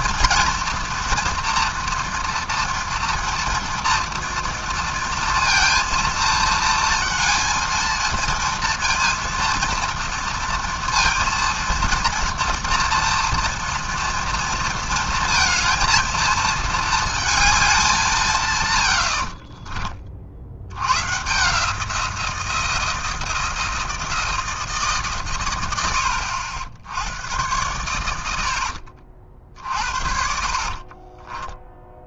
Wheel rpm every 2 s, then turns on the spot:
240, 230, 230, 230, 230, 230, 230, 230, 220, 120, 100, 170, 150, 80, 70, 40.
28-32